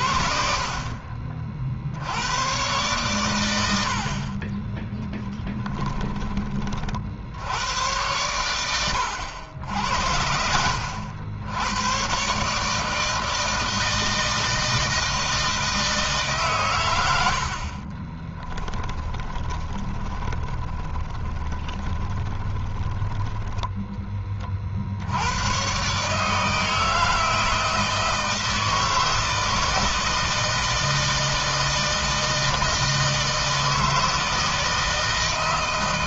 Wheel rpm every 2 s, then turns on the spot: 50, 110, 20, 30, 100, 80, 150, 160, 120, 20, 20, 10, 50, 160, 160, 160, 160, 160.
18-24